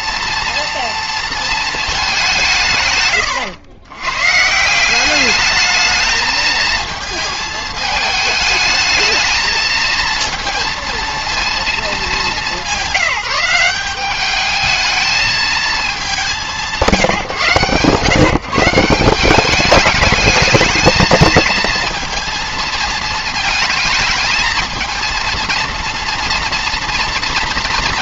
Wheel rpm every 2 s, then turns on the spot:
230, 150, 170, 220, 220, 230, 190, 210, 170, 160, 220, 230, 230, 230.
none